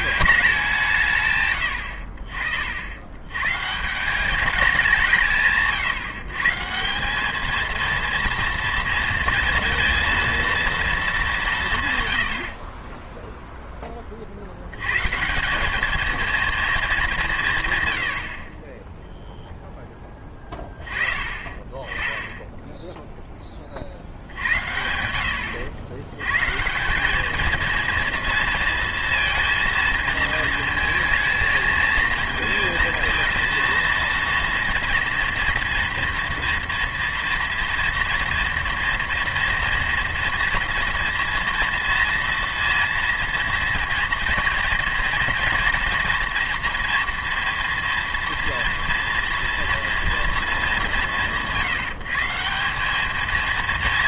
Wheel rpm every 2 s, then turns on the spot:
170, 60, 190, 180, 230, 220, 40, 100, 220, 20, 20, 0, 90, 170, 230, 220, 220, 230, 230, 230, 230, 230, 230, 230, 230, 200, 200.
18-20